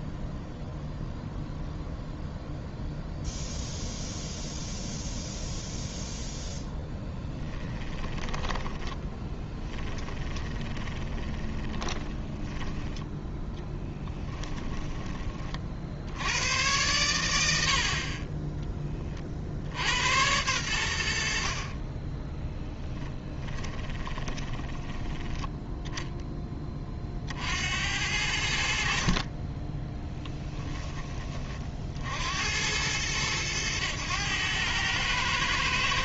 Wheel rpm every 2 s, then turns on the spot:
0, 0, 0, 0, 10, 20, 30, 20, 100, 20, 80, 20, 10, 30, 50, 10, 100, 110.
8-12 22-26